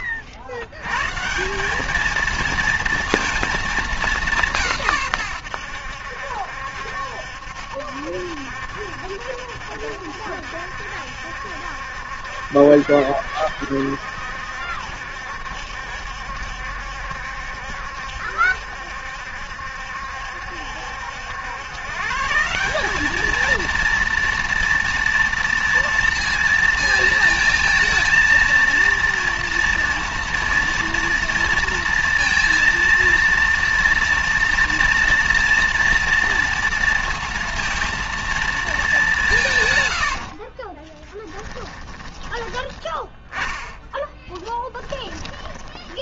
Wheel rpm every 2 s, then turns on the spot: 110, 230, 150, 70, 70, 70, 70, 70, 70, 70, 70, 190, 230, 230, 230, 230, 230, 240, 230, 220, 30, 20, 20.
40-46